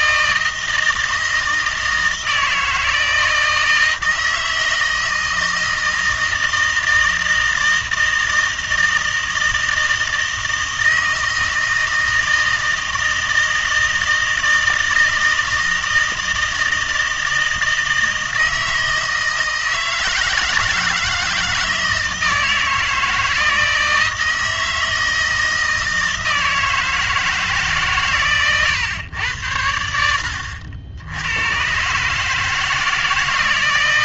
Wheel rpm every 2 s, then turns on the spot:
160, 160, 160, 160, 160, 160, 160, 160, 160, 160, 160, 160, 160, 160, 120, 80, 160.
none